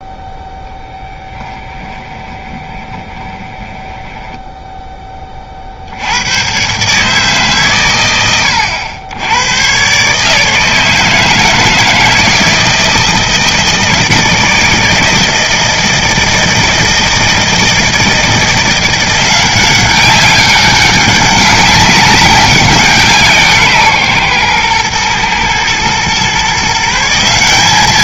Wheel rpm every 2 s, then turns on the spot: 0, 20, 10, 100, 100, 150, 160, 160, 160, 170, 200, 190, 120, 140.
2-6